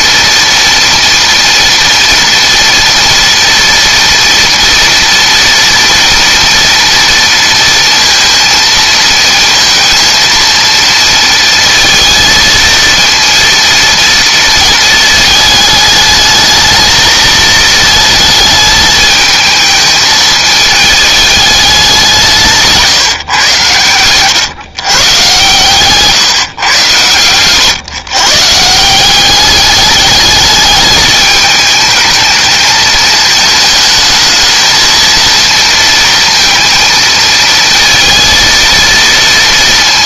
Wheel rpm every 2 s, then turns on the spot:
230, 230, 230, 230, 230, 230, 230, 220, 220, 220, 220, 160, 130, 120, 160, 210, 220, 220, 230, 230.
none